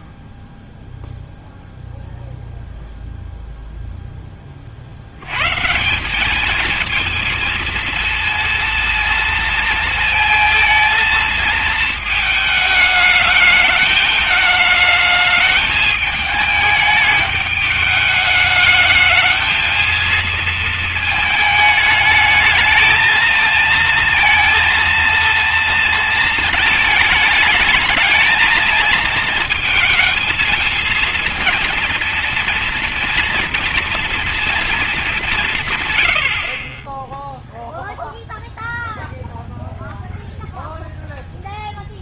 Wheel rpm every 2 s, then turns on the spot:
0, 0, 40, 210, 230, 230, 220, 220, 210, 220, 230, 220, 230, 220, 220, 220, 230, 220, 40, 0, 0.
none